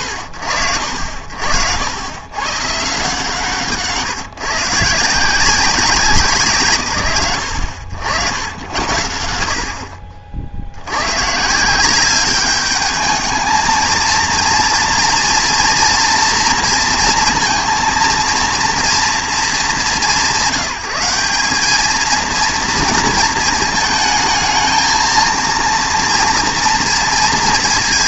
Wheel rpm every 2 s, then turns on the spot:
70, 130, 140, 120, 90, 70, 210, 230, 230, 230, 170, 230, 220, 230.
none